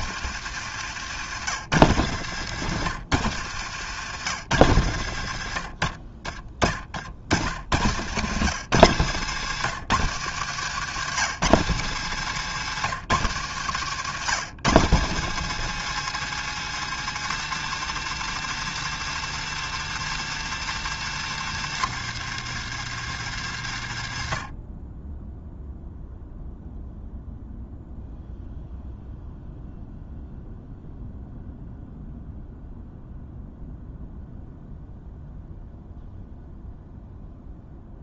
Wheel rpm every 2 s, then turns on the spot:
110, 100, 70, 60, 130, 140, 120, 150, 160, 160, 150, 120, 10, 0, 0, 0, 0, 0, 0.
6-10